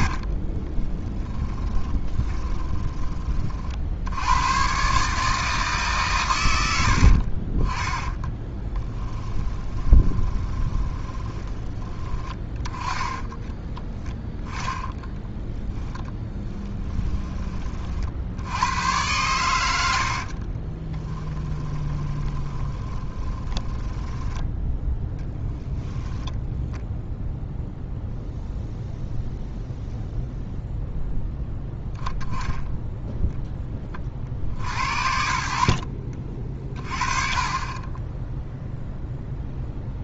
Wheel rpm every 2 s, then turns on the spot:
20, 10, 120, 80, 10, 20, 20, 20, 20, 100, 30, 20, 10, 0, 0, 0, 0, 60, 40, 0.
0-2 8-12 14-18 20-24